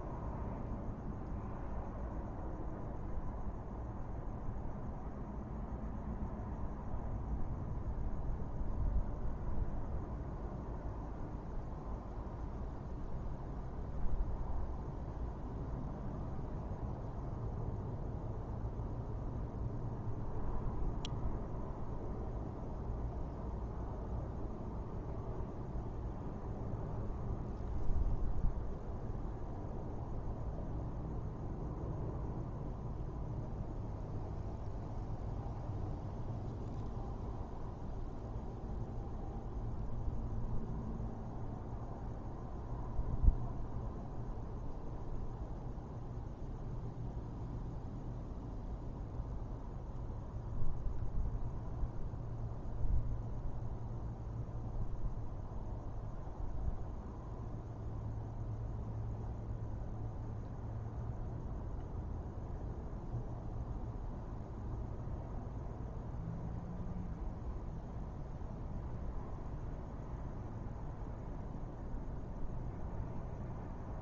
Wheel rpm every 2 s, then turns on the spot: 0, 0, 0, 0, 0, 0, 0, 0, 0, 0, 0, 0, 0, 0, 0, 0, 0, 0, 0, 0, 0, 0, 0, 0, 0, 0, 0, 0, 0, 0, 0, 0, 0, 0, 0, 0, 0.
none